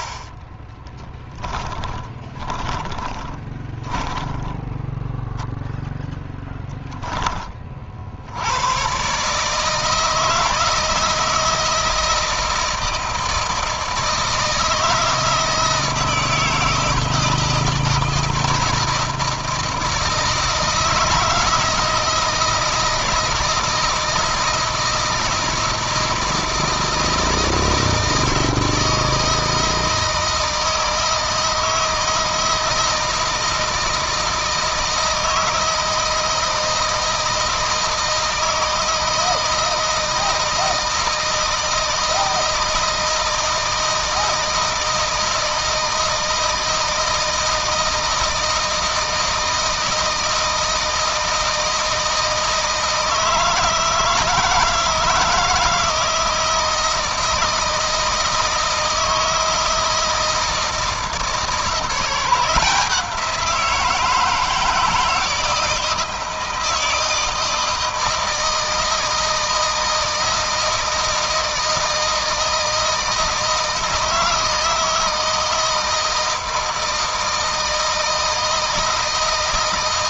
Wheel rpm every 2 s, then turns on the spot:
20, 30, 10, 10, 120, 160, 160, 160, 160, 160, 170, 160, 160, 160, 160, 160, 160, 160, 160, 160, 160, 160, 160, 160, 160, 160, 160, 160, 160, 160, 160, 180, 170, 160, 160, 160, 160, 160, 160, 160.
0-4